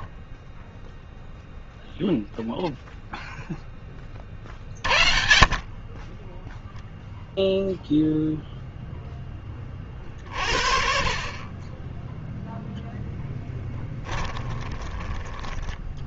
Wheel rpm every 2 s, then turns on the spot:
10, 0, 40, 0, 0, 40, 0, 10.
none